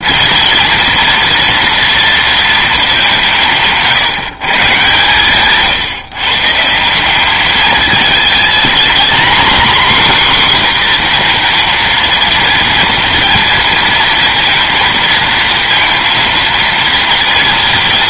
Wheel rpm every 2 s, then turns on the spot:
230, 210, 140, 160, 230, 250, 230, 230, 230.
none